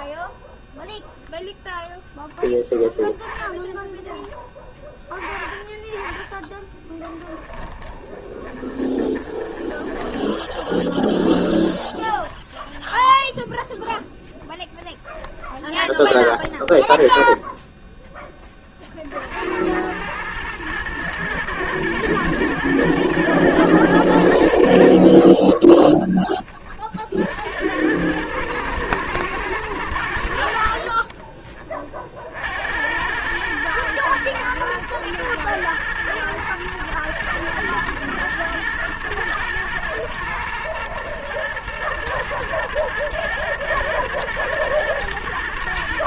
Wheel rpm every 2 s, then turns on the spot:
0, 0, 10, 20, 20, 20, 10, 0, 10, 30, 110, 110, 70, 30, 110, 60, 60, 120, 110, 110, 110, 110, 110.
8-14